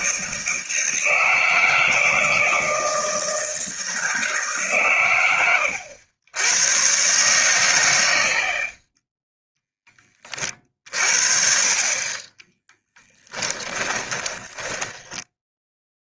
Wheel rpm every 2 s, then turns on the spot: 160, 160, 140, 120, 30, 40, 10, 10.
12-16